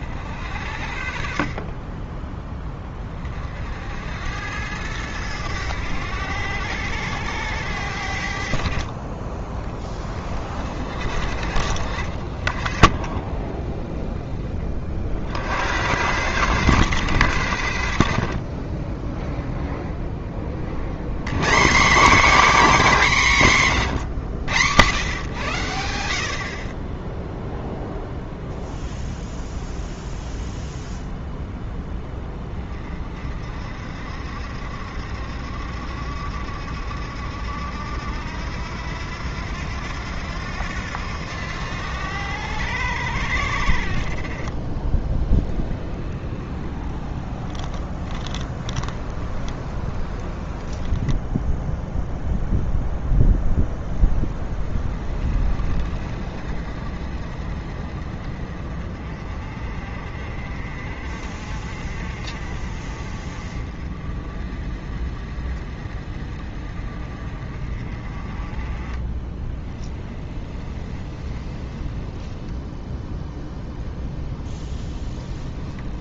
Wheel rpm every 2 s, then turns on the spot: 60, 20, 100, 90, 50, 40, 40, 40, 120, 20, 60, 260, 120, 40, 0, 0, 30, 70, 70, 80, 90, 90, 20, 20, 20, 20, 10, 30, 40, 40, 40, 40, 40, 40, 20, 20, 10, 10.
12-14 44-52 70-72 74-76